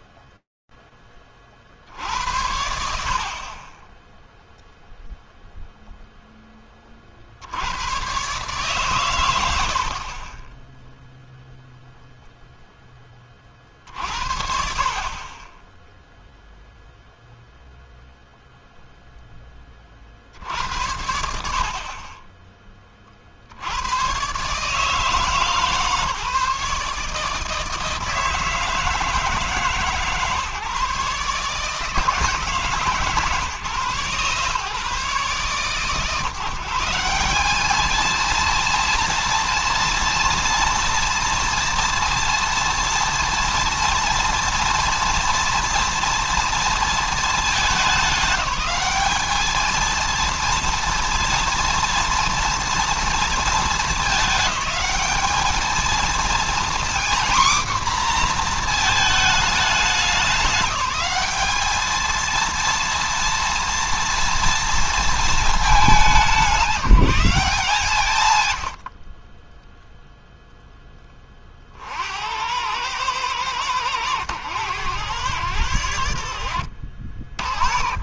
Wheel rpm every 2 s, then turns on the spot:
0, 70, 10, 10, 130, 30, 10, 40, 0, 10, 70, 50, 160, 150, 160, 140, 140, 140, 190, 230, 230, 230, 230, 220, 210, 230, 230, 210, 240, 220, 210, 230, 220, 180, 50, 20, 100, 90, 50.
68-70